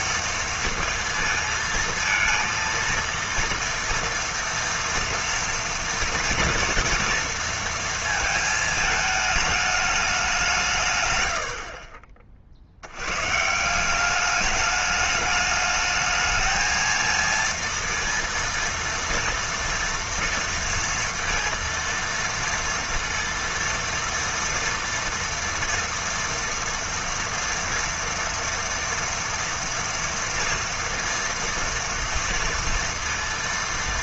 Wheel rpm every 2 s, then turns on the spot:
230, 230, 230, 230, 220, 150, 80, 210, 220, 230, 230, 230, 230, 230, 230, 230, 230.
none